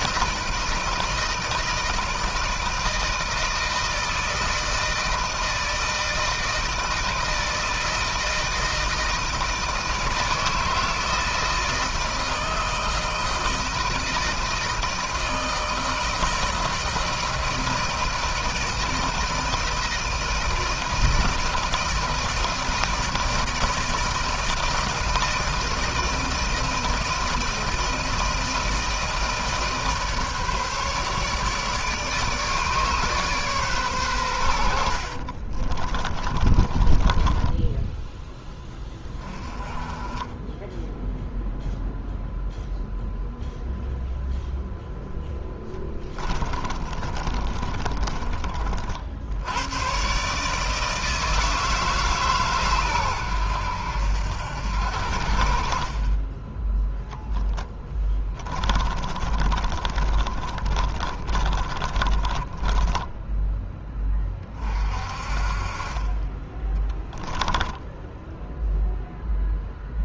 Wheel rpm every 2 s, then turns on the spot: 160, 160, 170, 160, 160, 160, 160, 160, 160, 160, 160, 160, 160, 160, 160, 150, 150, 90, 20, 10, 10, 0, 0, 20, 40, 140, 140, 80, 10, 20, 30, 20, 30, 20, 0.
34-38 46-48 58-64 66-68